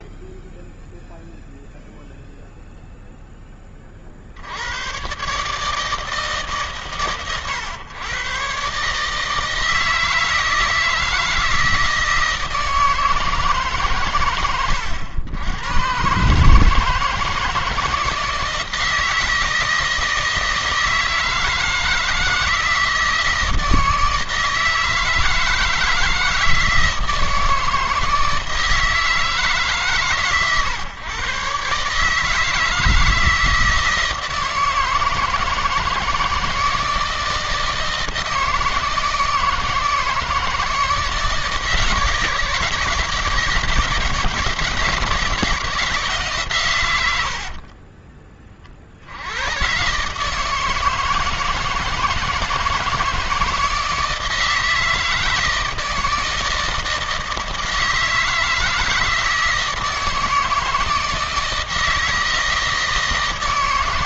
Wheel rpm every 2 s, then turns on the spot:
0, 0, 80, 150, 120, 160, 160, 100, 150, 160, 160, 160, 160, 160, 160, 130, 150, 160, 160, 160, 160, 160, 160, 140, 40, 150, 160, 160, 160, 160, 160, 160.
none